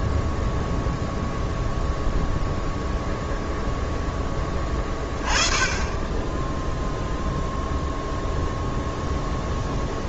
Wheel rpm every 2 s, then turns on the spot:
0, 0, 20, 0, 0.
none